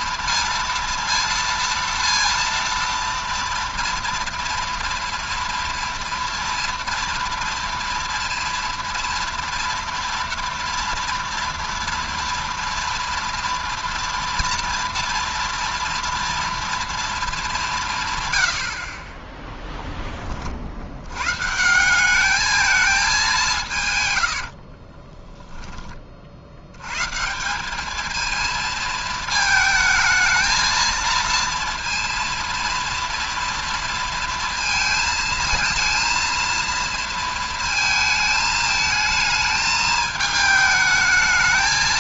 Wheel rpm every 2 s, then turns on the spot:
230, 230, 230, 230, 230, 230, 230, 230, 230, 100, 50, 220, 60, 70, 220, 220, 230, 230, 230, 220, 220.
24-26